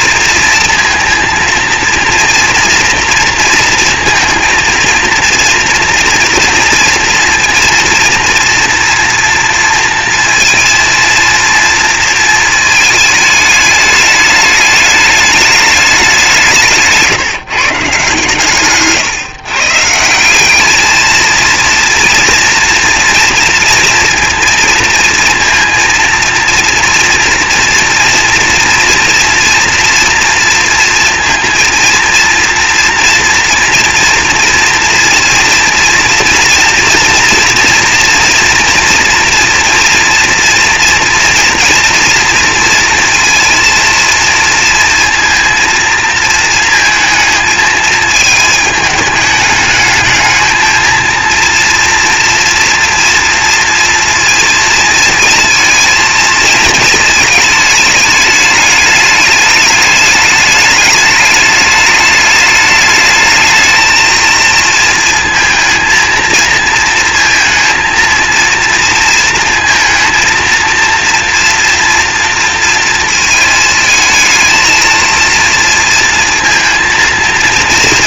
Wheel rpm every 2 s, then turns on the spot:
230, 230, 230, 230, 240, 230, 220, 210, 170, 140, 200, 230, 230, 230, 240, 230, 230, 230, 230, 230, 240, 230, 230, 220, 210, 220, 230, 230, 220, 210, 210, 210, 230, 230, 230, 230, 230, 220, 230.
none